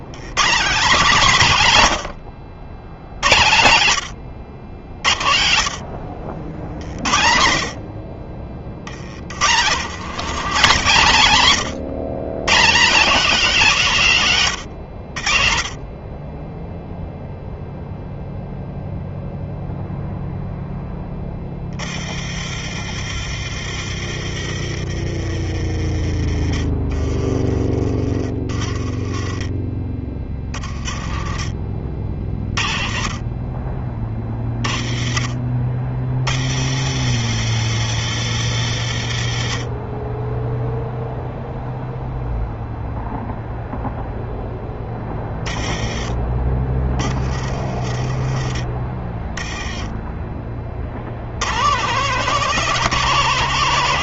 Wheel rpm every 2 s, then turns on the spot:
190, 80, 90, 80, 50, 160, 180, 160, 20, 0, 0, 40, 40, 20, 30, 30, 40, 30, 80, 110, 20, 0, 0, 20, 30, 20, 170.
none